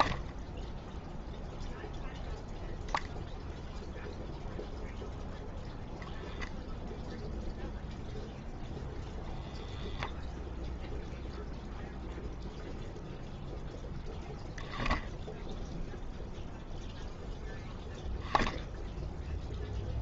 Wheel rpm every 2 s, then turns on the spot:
0, 0, 0, 0, 0, 0, 0, 0, 0, 0.
none